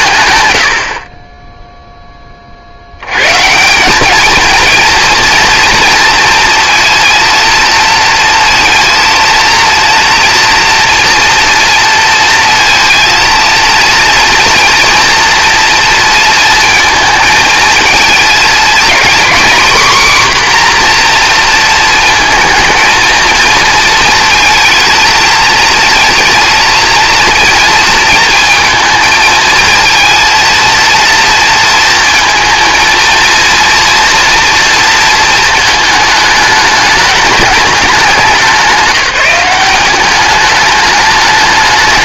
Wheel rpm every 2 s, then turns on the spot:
150, 20, 220, 230, 230, 230, 230, 230, 230, 220, 260, 220, 220, 230, 220, 230, 230, 230, 210, 200, 200.
none